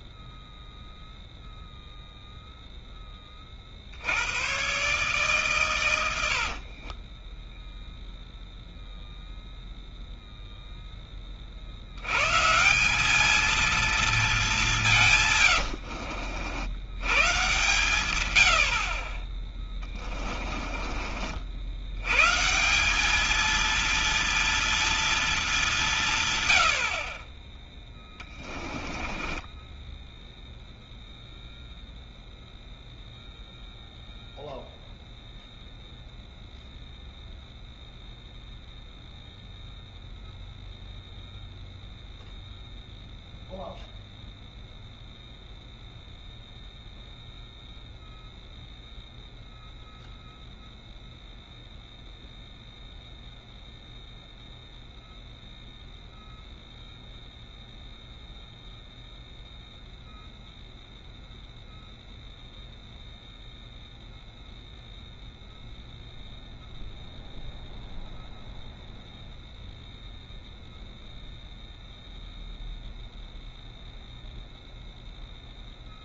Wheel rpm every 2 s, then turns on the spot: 0, 0, 120, 40, 0, 0, 170, 180, 80, 80, 30, 160, 230, 70, 20, 0, 0, 0, 0, 0, 0, 0, 0, 0, 0, 0, 0, 0, 0, 0, 0, 0, 0, 0, 0, 0, 0, 0.
6-8 28-30